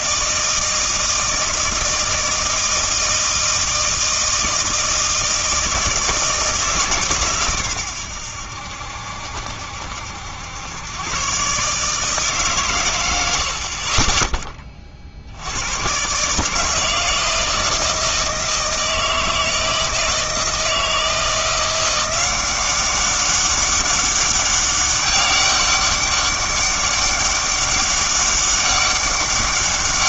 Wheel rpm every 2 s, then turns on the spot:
160, 160, 160, 150, 80, 100, 130, 20, 160, 160, 160, 190, 200, 200, 200.
none